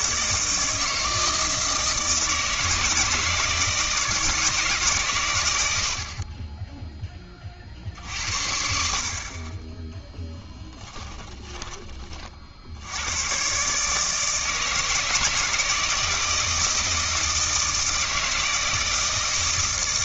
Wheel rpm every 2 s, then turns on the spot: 160, 160, 150, 20, 60, 10, 70, 160, 160, 160.
10-12